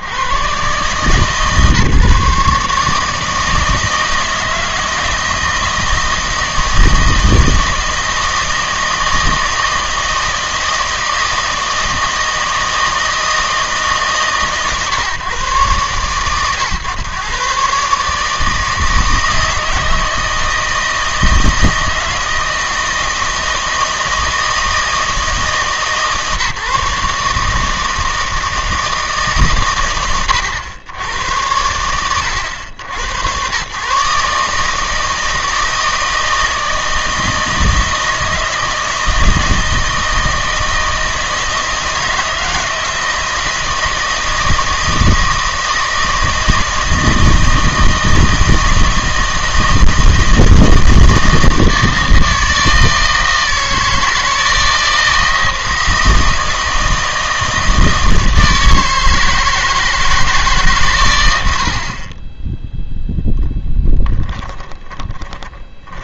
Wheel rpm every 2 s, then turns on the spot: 100, 150, 160, 160, 160, 160, 160, 140, 130, 160, 160, 160, 160, 150, 160, 70, 100, 150, 160, 160, 160, 160, 160, 160, 160, 160, 160, 160, 160, 160, 150, 10, 10.
64-66